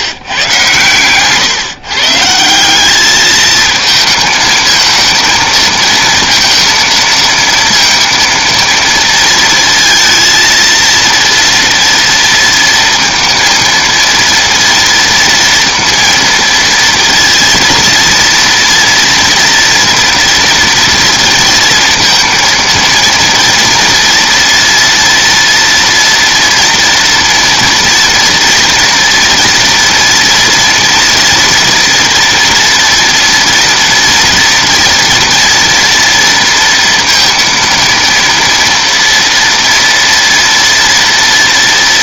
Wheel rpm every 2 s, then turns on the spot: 110, 190, 220, 230, 230, 230, 230, 230, 230, 230, 230, 230, 230, 230, 230, 230, 230, 230, 230, 230, 230.
none